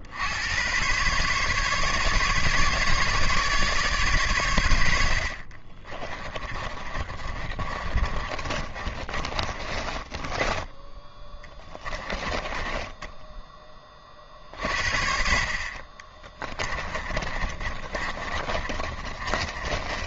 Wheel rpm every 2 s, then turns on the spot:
110, 150, 100, 30, 30, 20, 20, 50, 20, 30.
6-14 16-20